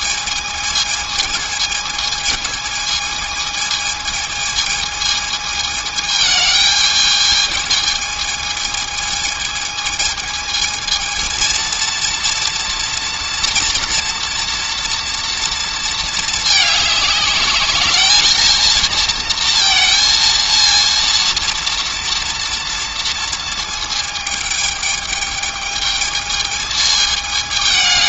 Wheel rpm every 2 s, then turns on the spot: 220, 220, 220, 220, 220, 220, 230, 230, 210, 230, 230, 230, 220, 220.
none